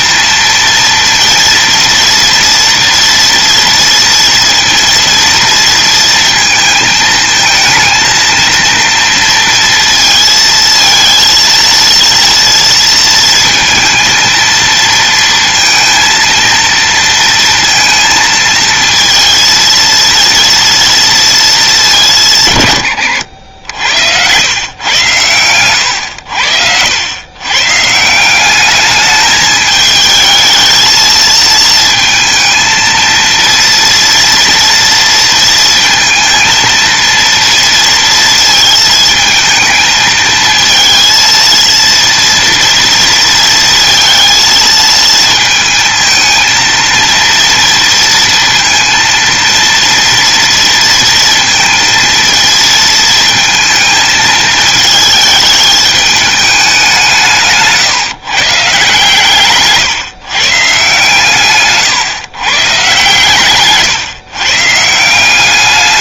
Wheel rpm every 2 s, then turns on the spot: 230, 230, 230, 220, 230, 230, 230, 230, 230, 230, 230, 110, 110, 100, 210, 220, 230, 230, 230, 220, 230, 230, 220, 230, 230, 230, 230, 220, 170, 140, 140, 130, 160.
none